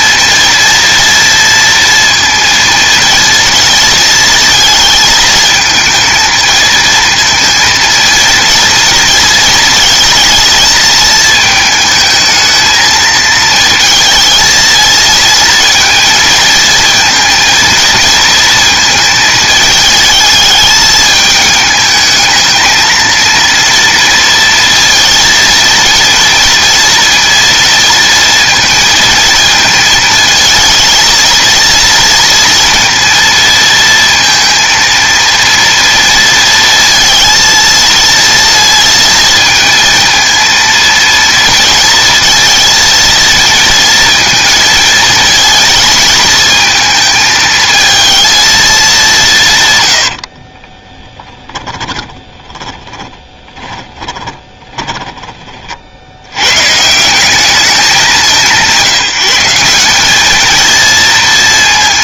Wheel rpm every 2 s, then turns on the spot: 230, 230, 220, 230, 230, 230, 220, 230, 230, 230, 220, 220, 230, 230, 230, 220, 230, 230, 230, 230, 230, 230, 230, 230, 220, 50, 30, 20, 130, 190, 220.
50-56